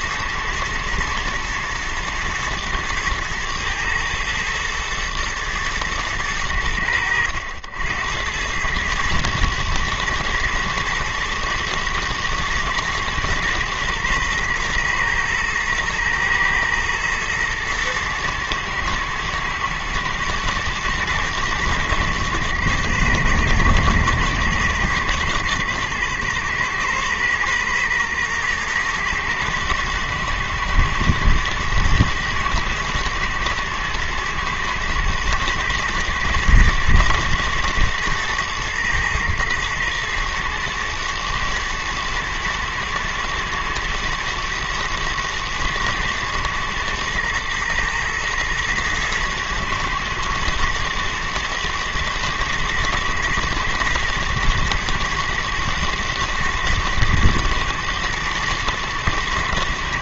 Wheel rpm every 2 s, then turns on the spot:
120, 110, 110, 90, 100, 110, 110, 120, 110, 120, 110, 110, 110, 120, 120, 110, 110, 110, 110, 110, 110, 120, 120, 120, 110, 110, 110, 110, 110, 110.
none